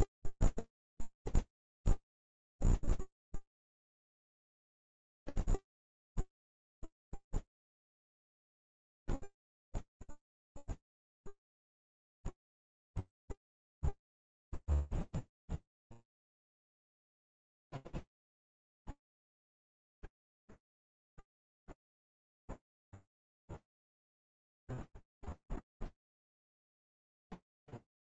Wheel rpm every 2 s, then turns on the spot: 0, 0, 0, 0, 0, 0, 0, 0, 0, 0, 0, 0, 0, 0.
none